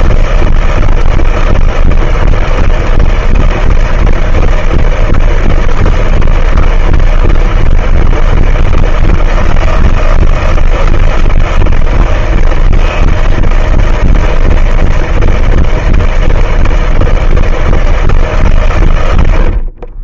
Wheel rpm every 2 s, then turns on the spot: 160, 160, 160, 160, 160, 160, 160, 160, 160, 150.
none